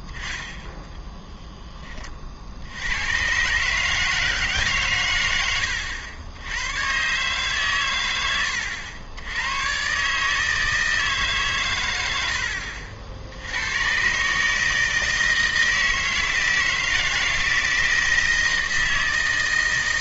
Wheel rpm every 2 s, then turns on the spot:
10, 80, 140, 100, 90, 160, 70, 160, 160, 160.
none